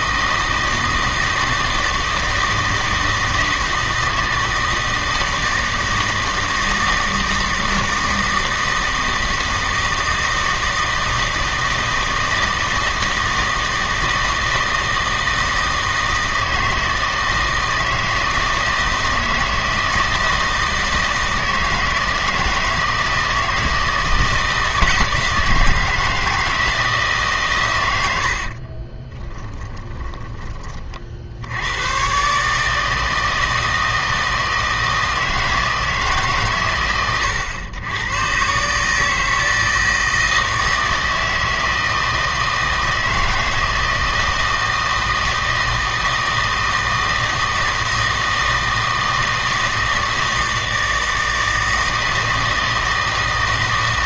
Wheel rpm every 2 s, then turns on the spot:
160, 160, 160, 160, 160, 160, 160, 160, 160, 160, 160, 160, 160, 160, 40, 30, 160, 160, 120, 140, 160, 160, 160, 160, 160, 160, 160.
28-30